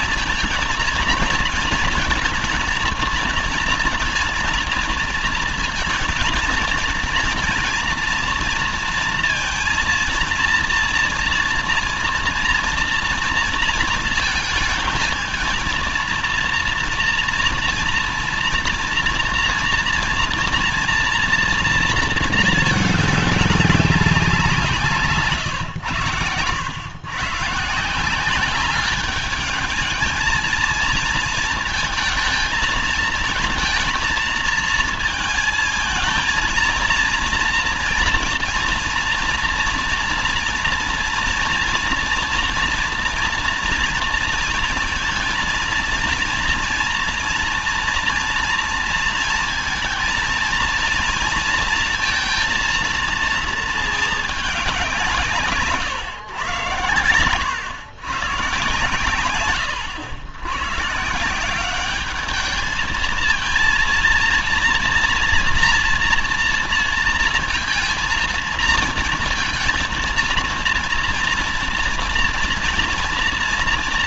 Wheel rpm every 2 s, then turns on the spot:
230, 220, 230, 230, 230, 230, 230, 230, 240, 230, 230, 210, 160, 120, 210, 230, 220, 220, 230, 230, 230, 230, 230, 230, 230, 230, 230, 180, 100, 110, 140, 220, 230, 230, 230, 230, 230.
none